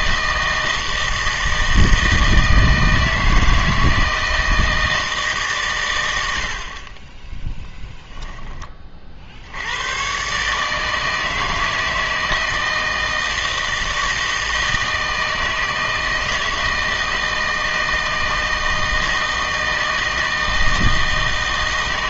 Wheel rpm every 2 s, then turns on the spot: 160, 160, 160, 60, 20, 150, 160, 160, 160, 160, 160.
none